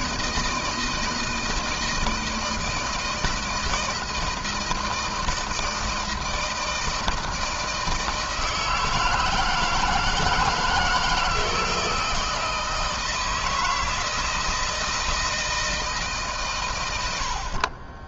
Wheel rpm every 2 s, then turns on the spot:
160, 160, 160, 160, 160, 160, 160, 160, 100.
none